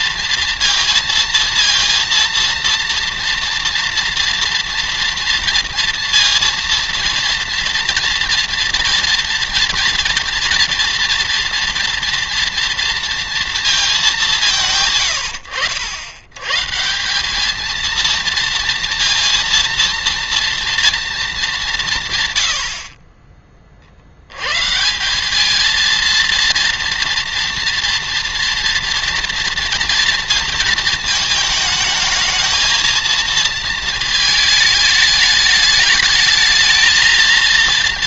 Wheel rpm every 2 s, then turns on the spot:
230, 230, 230, 230, 240, 230, 230, 150, 150, 230, 230, 50, 160, 230, 230, 220, 220, 220, 230.
none